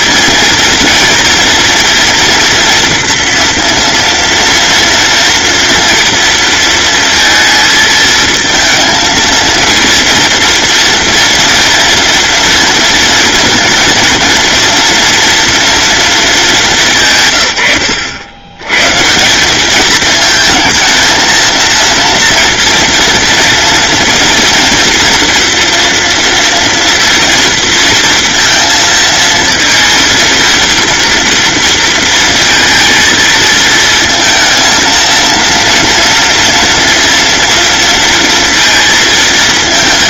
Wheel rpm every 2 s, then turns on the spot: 230, 230, 230, 230, 220, 230, 230, 230, 180, 130, 220, 230, 240, 230, 230, 230, 230, 230, 230, 230.
none